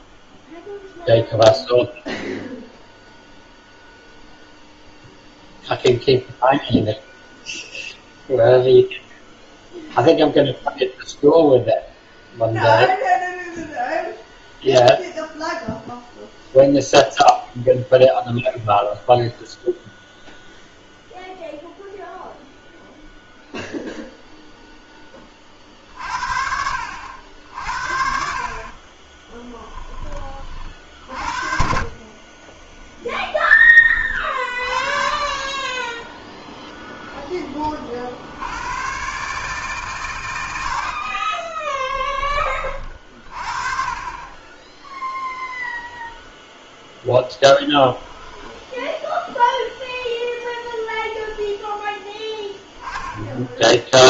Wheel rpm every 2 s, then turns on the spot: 0, 0, 0, 0, 0, 0, 0, 0, 0, 0, 0, 0, 10, 70, 40, 60, 10, 30, 0, 120, 60, 30, 10, 10, 10, 10, 10.
28-34 44-46 50-52